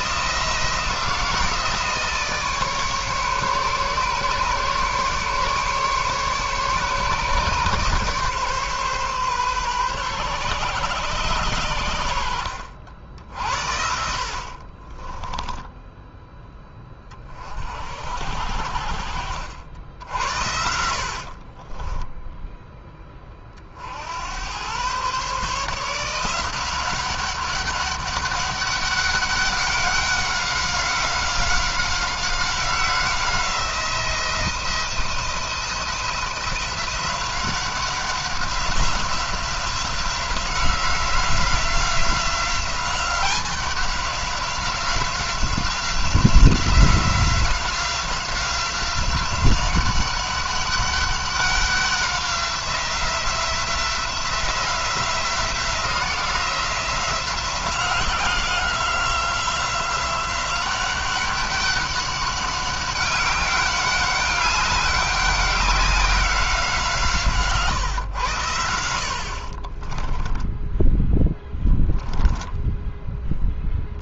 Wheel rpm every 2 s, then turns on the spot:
170, 150, 140, 140, 140, 130, 70, 20, 20, 60, 60, 20, 120, 190, 200, 190, 180, 170, 180, 180, 180, 190, 180, 180, 190, 200, 180, 180, 180, 180, 190, 200, 200, 160, 60, 10, 10.
14-16 20-22 70-72